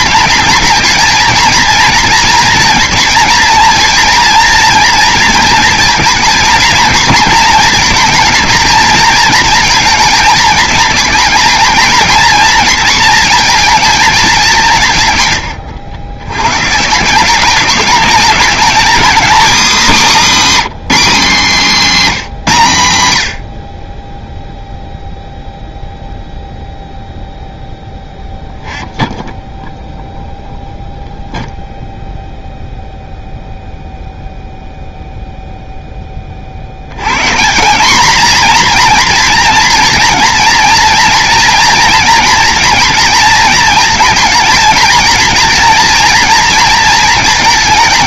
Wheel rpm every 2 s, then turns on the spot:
220, 230, 230, 230, 230, 220, 230, 170, 140, 220, 260, 150, 0, 0, 0, 0, 0, 0, 70, 240, 230, 230, 230, 220.
none